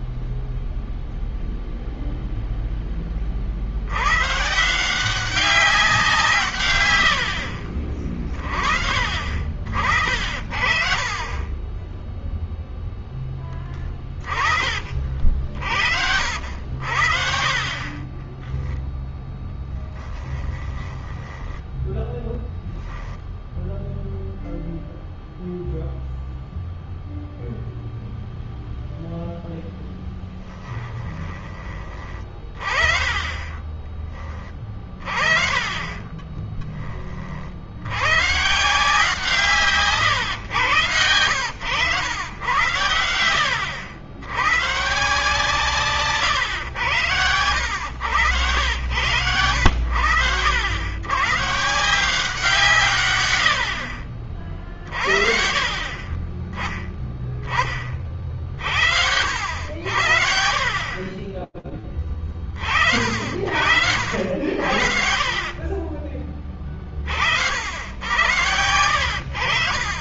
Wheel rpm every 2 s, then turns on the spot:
0, 10, 160, 120, 40, 40, 0, 30, 60, 10, 10, 0, 0, 0, 0, 10, 20, 30, 20, 150, 110, 90, 140, 90, 100, 100, 140, 30, 20, 70, 30, 60, 40, 50, 100.
10-12 18-22 30-32 54-58 60-64